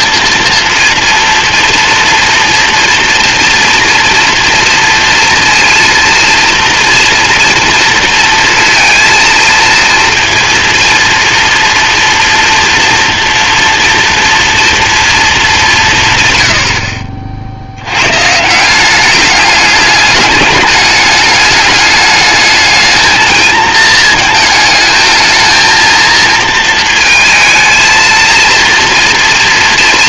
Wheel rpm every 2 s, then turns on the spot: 230, 230, 230, 230, 230, 230, 230, 230, 50, 190, 210, 210, 220, 230, 230.
none